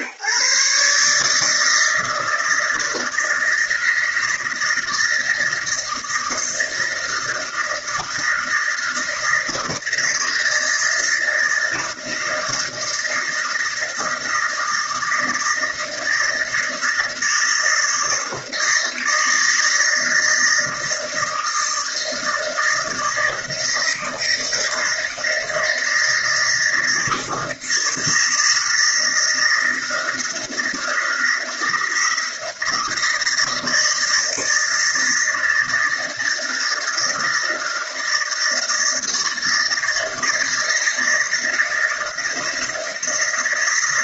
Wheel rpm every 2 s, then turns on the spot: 150, 160, 160, 160, 170, 160, 160, 160, 160, 160, 160, 160, 160, 160, 160, 170, 160, 160, 160, 160, 160, 160.
none